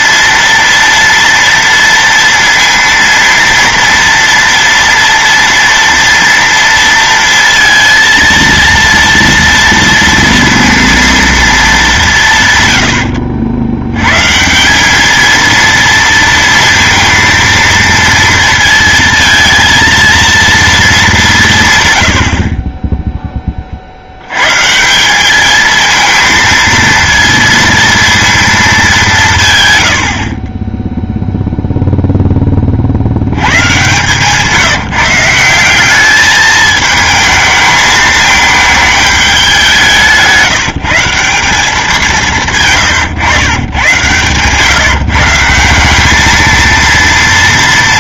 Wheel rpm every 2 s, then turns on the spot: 230, 230, 230, 230, 230, 230, 110, 190, 230, 230, 230, 30, 150, 230, 210, 10, 40, 160, 220, 220, 170, 150, 140, 230.
42-44